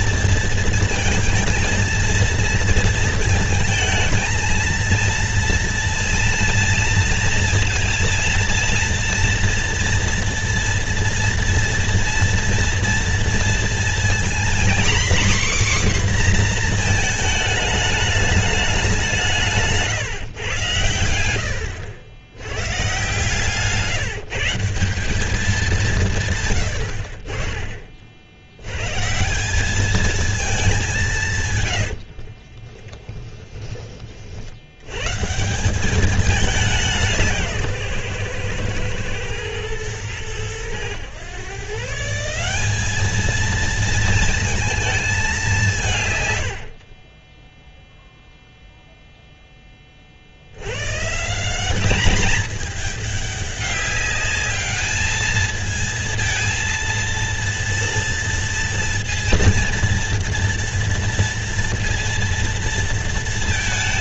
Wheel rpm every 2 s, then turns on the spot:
230, 230, 230, 230, 230, 240, 230, 250, 240, 210, 110, 120, 160, 100, 110, 200, 20, 90, 190, 120, 100, 200, 220, 60, 0, 110, 210, 210, 230, 230, 230, 230.
32-34